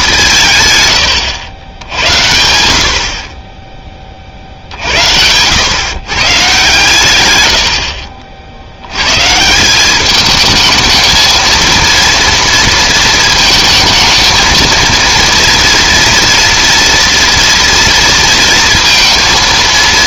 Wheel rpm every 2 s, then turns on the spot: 140, 70, 70, 140, 70, 220, 230, 230, 230, 230.
none